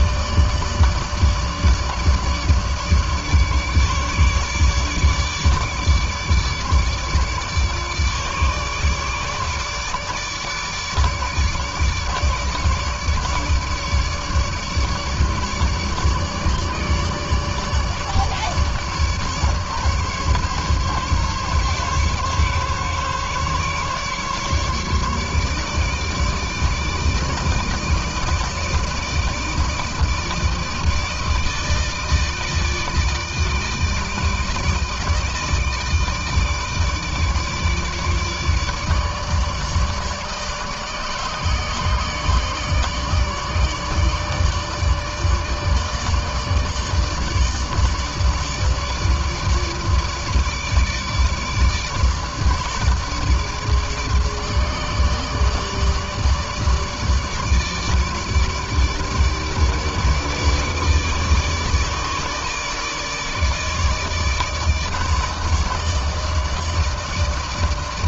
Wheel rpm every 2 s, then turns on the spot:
150, 150, 150, 150, 150, 150, 150, 150, 150, 150, 140, 140, 150, 160, 160, 160, 160, 160, 150, 150, 150, 150, 150, 150, 150, 150, 150, 150, 150, 150, 160, 150, 150, 150.
none